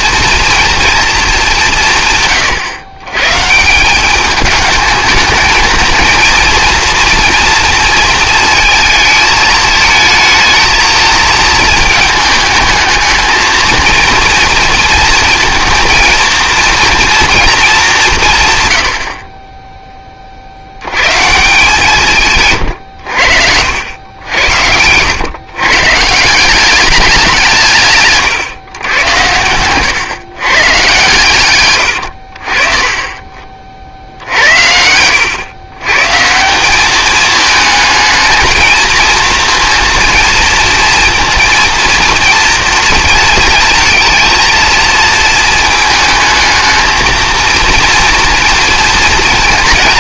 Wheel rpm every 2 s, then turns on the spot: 230, 120, 210, 230, 220, 220, 220, 220, 230, 90, 90, 100, 100, 200, 120, 130, 30, 80, 200, 220, 230, 230, 230, 220, 230.
34-36